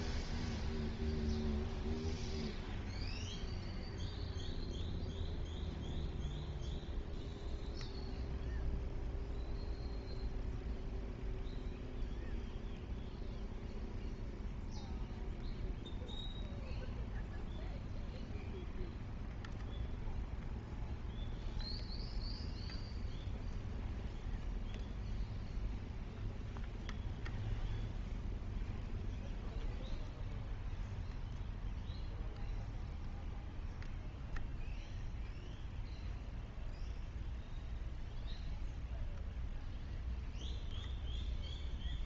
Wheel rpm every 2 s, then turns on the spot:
0, 0, 0, 0, 0, 0, 0, 0, 0, 0, 0, 0, 0, 0, 0, 0, 0, 0, 0, 0, 0.
none